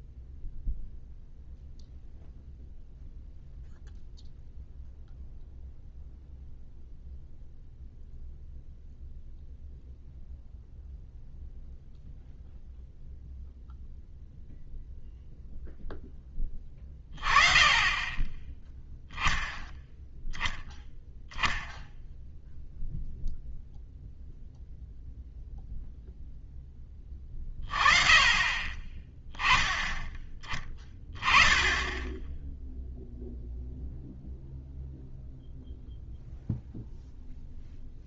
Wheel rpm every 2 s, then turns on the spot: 0, 0, 0, 0, 0, 0, 0, 0, 10, 10, 0, 0, 0, 10, 30, 10, 0, 0, 0.
none